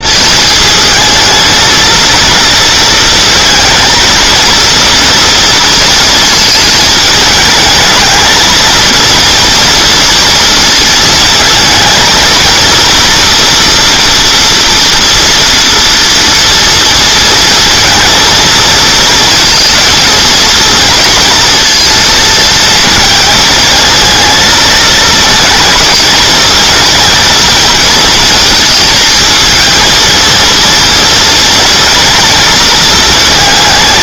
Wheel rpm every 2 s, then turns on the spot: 220, 230, 230, 220, 230, 230, 230, 230, 230, 220, 230, 230, 220, 230, 220, 230, 230.
none